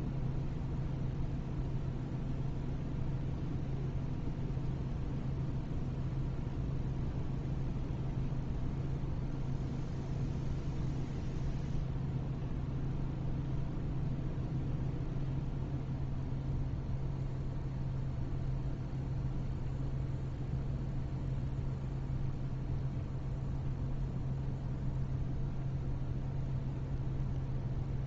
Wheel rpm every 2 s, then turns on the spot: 0, 0, 0, 0, 0, 0, 0, 0, 0, 0, 0, 0, 0, 0.
none